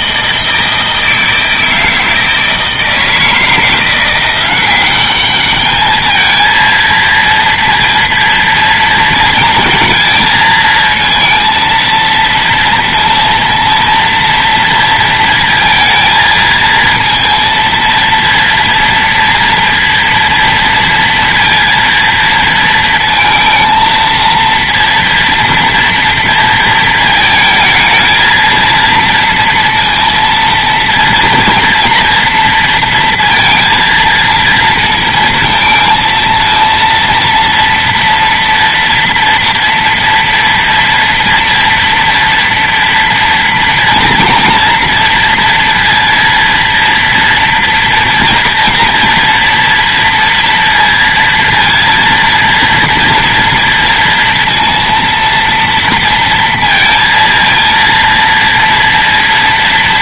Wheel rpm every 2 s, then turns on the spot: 160, 160, 190, 220, 230, 230, 230, 230, 230, 240, 230, 220, 230, 220, 230, 230, 230, 230, 230, 230, 230, 230, 230, 230, 230, 230, 230, 230, 230, 230.
none